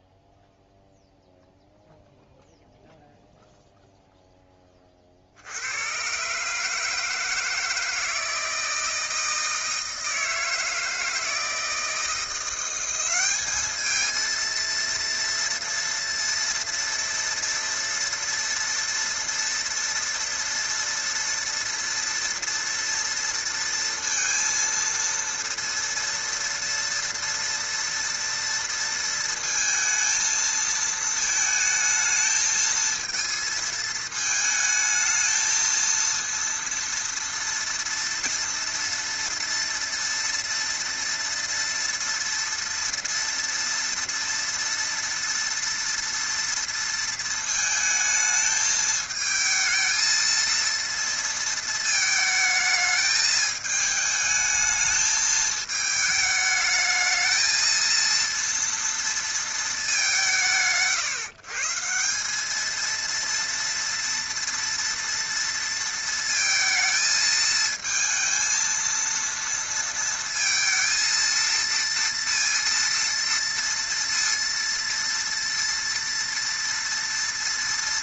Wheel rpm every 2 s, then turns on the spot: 0, 0, 10, 150, 160, 160, 170, 230, 230, 230, 230, 230, 230, 230, 230, 220, 220, 220, 230, 230, 230, 230, 230, 230, 220, 230, 220, 220, 210, 230, 130, 210, 240, 220, 230, 230, 230, 230, 230.
none